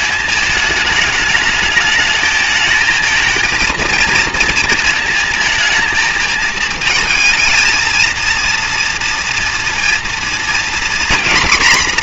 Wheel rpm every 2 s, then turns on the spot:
210, 220, 230, 220, 230, 240.
none